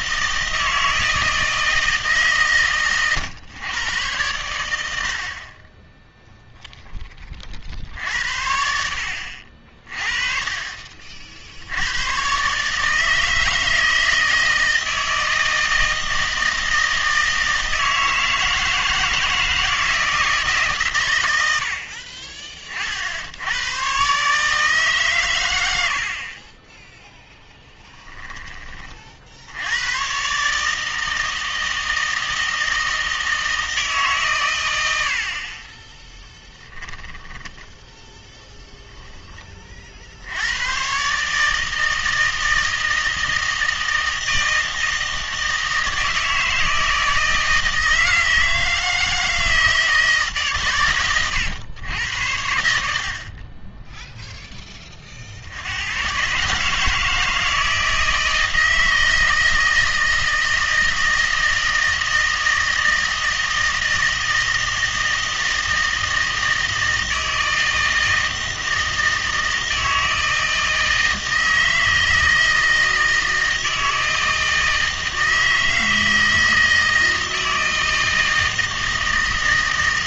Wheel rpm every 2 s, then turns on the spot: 160, 120, 80, 10, 70, 40, 150, 160, 160, 160, 130, 40, 150, 10, 30, 160, 160, 100, 10, 0, 120, 160, 160, 160, 160, 130, 70, 20, 150, 160, 160, 160, 160, 160, 160, 160, 160, 160, 160, 160.
none